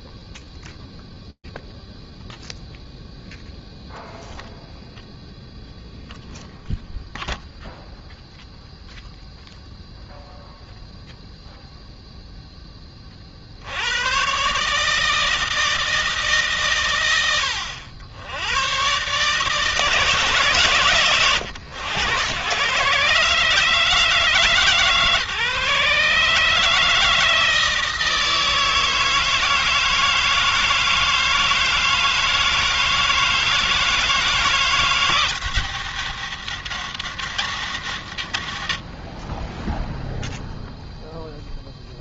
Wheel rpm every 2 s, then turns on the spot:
0, 0, 0, 0, 0, 0, 120, 150, 80, 150, 110, 150, 150, 160, 160, 160, 160, 190, 140, 0, 0.
none